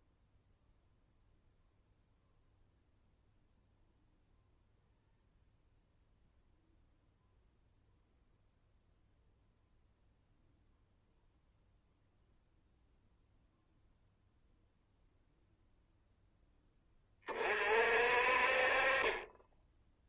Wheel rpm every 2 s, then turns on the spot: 0, 0, 0, 0, 0, 0, 0, 0, 20, 30.
none